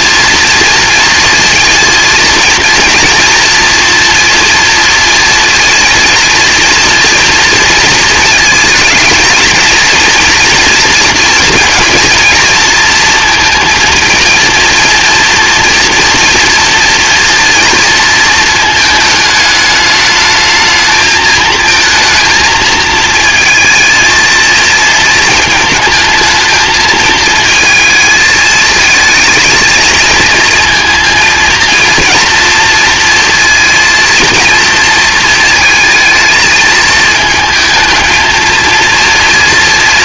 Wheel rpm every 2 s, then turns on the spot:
230, 230, 230, 230, 220, 230, 230, 230, 230, 220, 220, 220, 230, 220, 220, 230, 230, 230, 220, 230.
none